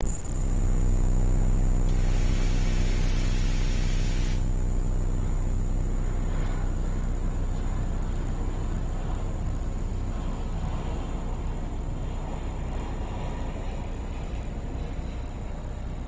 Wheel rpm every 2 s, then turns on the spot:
0, 0, 0, 0, 0, 0, 0, 0.
none